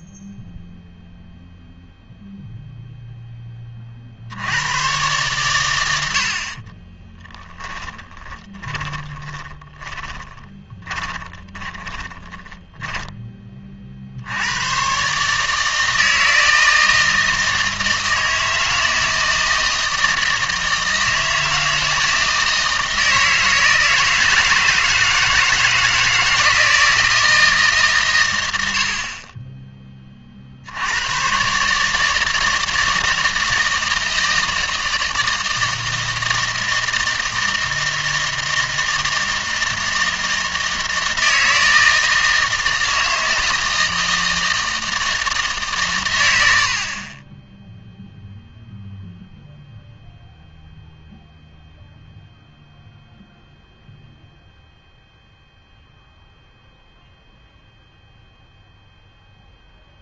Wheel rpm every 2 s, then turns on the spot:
0, 0, 110, 30, 20, 20, 10, 110, 160, 160, 160, 160, 160, 160, 70, 80, 160, 160, 160, 160, 160, 160, 160, 60, 0, 0, 0, 0, 0, 0.
6-14